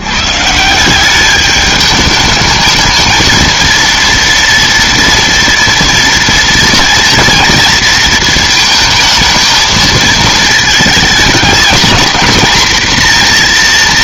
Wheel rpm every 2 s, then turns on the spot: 140, 210, 230, 230, 220, 220, 230.
none